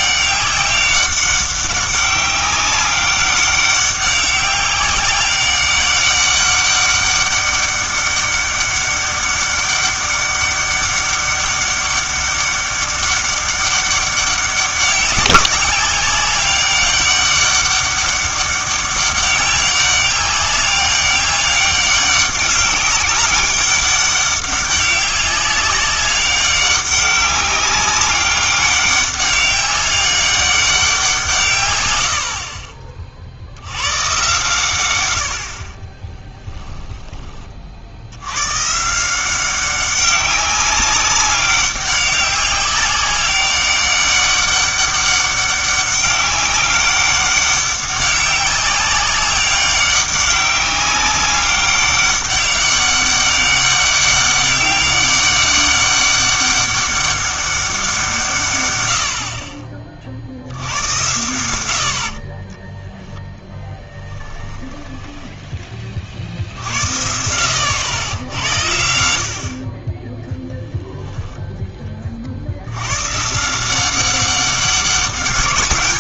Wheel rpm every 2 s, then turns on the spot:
200, 190, 200, 200, 200, 200, 200, 190, 200, 200, 200, 200, 200, 200, 200, 190, 40, 110, 10, 130, 200, 190, 200, 200, 190, 200, 200, 200, 200, 120, 90, 10, 10, 70, 70, 10, 80, 190.
36-38 62-66